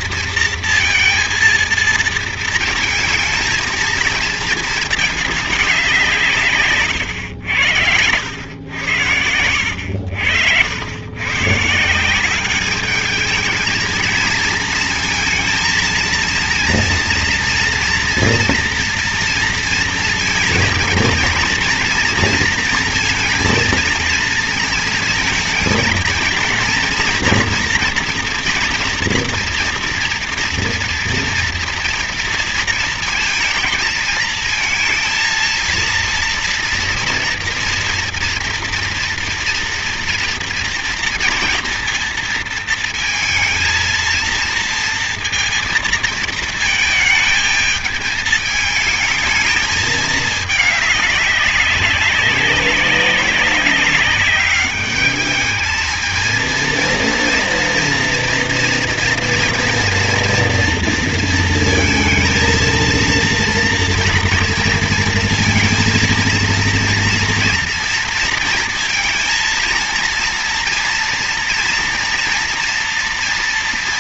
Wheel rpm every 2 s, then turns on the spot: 230, 220, 220, 120, 90, 90, 210, 220, 230, 230, 230, 230, 220, 230, 230, 230, 230, 230, 230, 230, 230, 230, 230, 220, 220, 210, 190, 200, 230, 240, 230, 230, 230, 230, 230, 230, 230.
8-10